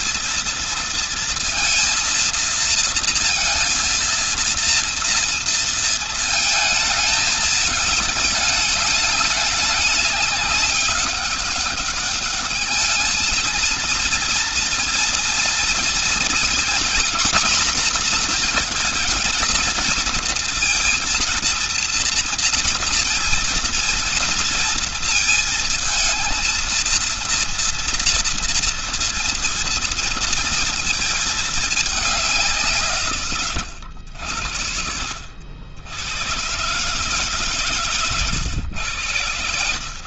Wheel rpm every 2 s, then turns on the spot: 220, 230, 230, 220, 210, 200, 210, 230, 240, 240, 230, 230, 230, 230, 230, 230, 180, 70, 120, 120.
none